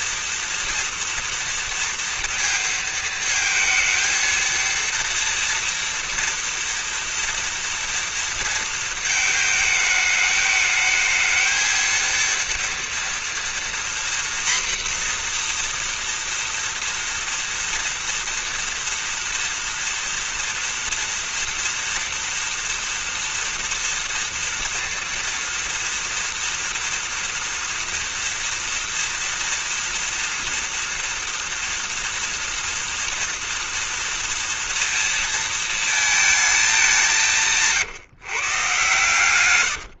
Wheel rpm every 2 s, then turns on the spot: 230, 230, 230, 230, 230, 220, 230, 240, 240, 230, 230, 230, 230, 230, 240, 240, 240, 230, 220, 160.
none